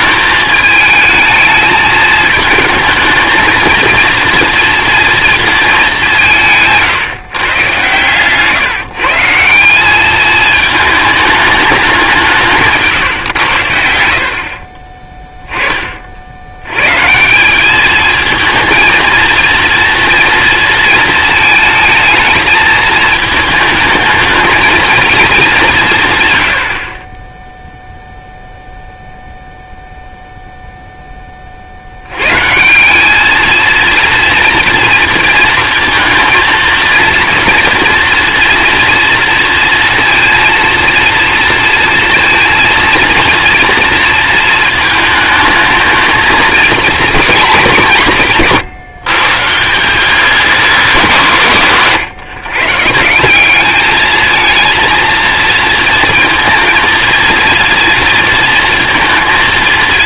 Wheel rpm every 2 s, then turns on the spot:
220, 220, 230, 160, 150, 220, 150, 20, 110, 220, 230, 220, 220, 70, 0, 0, 160, 230, 230, 230, 230, 230, 220, 240, 160, 210, 140, 230, 230, 230.
none